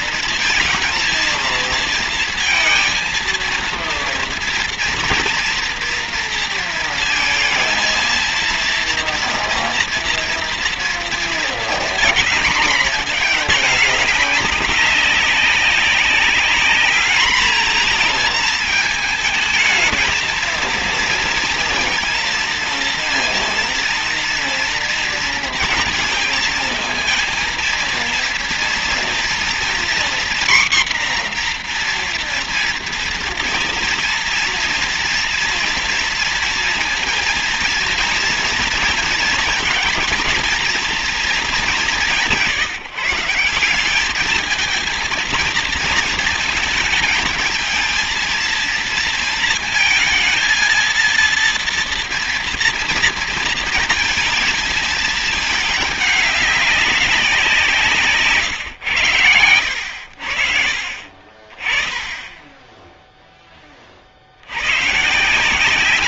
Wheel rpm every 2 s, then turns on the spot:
230, 220, 230, 230, 230, 230, 220, 200, 210, 220, 230, 230, 230, 220, 230, 250, 240, 230, 230, 230, 230, 160, 220, 220, 220, 230, 230, 220, 200, 130, 60, 10, 90.
none